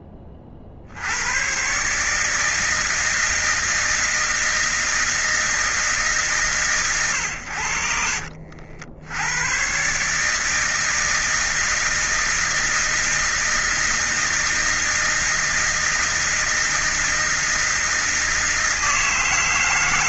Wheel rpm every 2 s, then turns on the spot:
30, 150, 160, 140, 50, 160, 160, 160, 160, 160.
none